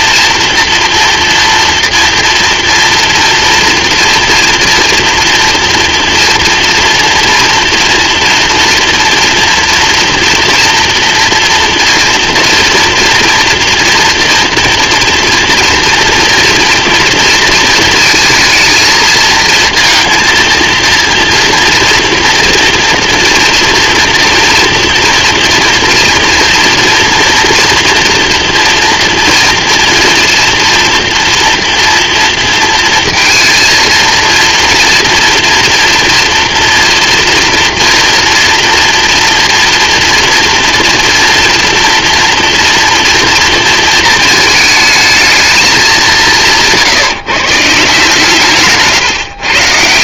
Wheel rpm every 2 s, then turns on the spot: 230, 240, 230, 240, 230, 230, 230, 240, 230, 220, 230, 230, 230, 230, 240, 230, 230, 230, 230, 240, 230, 230, 220, 160, 150.
none